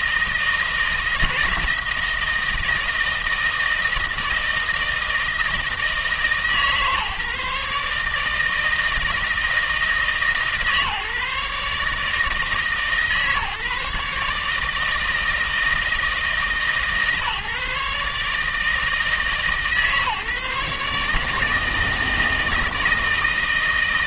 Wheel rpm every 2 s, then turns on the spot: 160, 160, 160, 150, 160, 150, 150, 160, 150, 150, 150, 160.
none